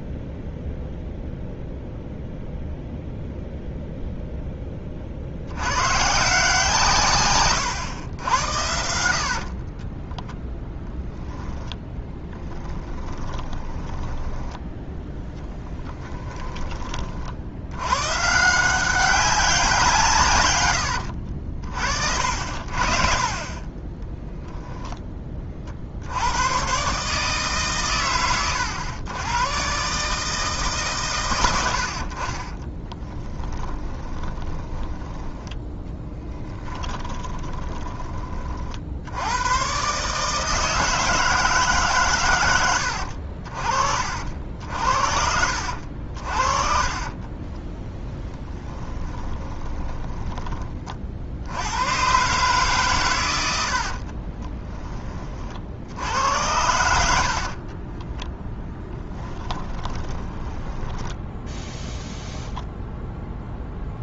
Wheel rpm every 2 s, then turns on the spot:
0, 0, 30, 150, 80, 10, 10, 10, 30, 180, 100, 50, 10, 130, 100, 150, 30, 10, 10, 60, 160, 80, 60, 30, 10, 40, 130, 20, 80, 20, 10, 0.
8-10 12-14 20-22 32-38 48-50 56-62